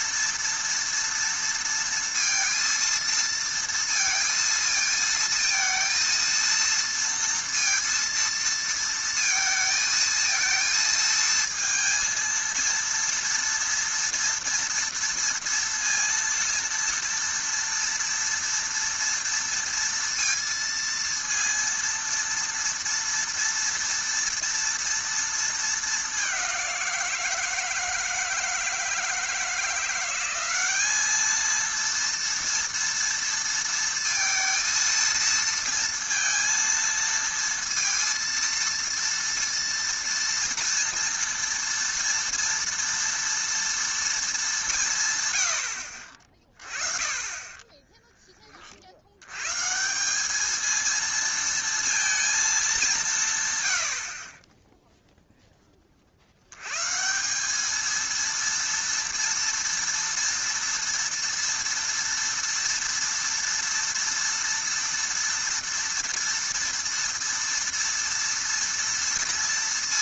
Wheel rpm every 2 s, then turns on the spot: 230, 230, 230, 230, 230, 230, 230, 230, 230, 230, 230, 230, 230, 190, 160, 200, 230, 230, 230, 230, 230, 230, 200, 30, 40, 210, 210, 20, 100, 230, 230, 230, 230, 230, 230.
none